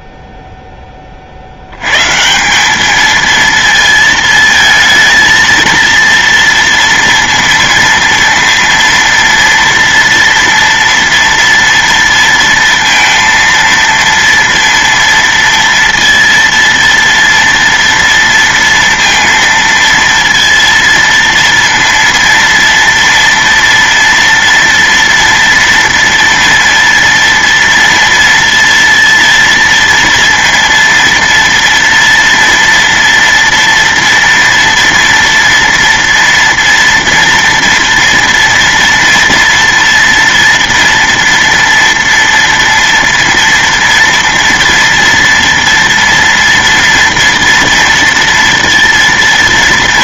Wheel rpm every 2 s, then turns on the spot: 0, 180, 220, 230, 230, 240, 230, 230, 230, 230, 230, 230, 230, 230, 230, 230, 230, 230, 230, 240, 230, 230, 230, 230, 230.
none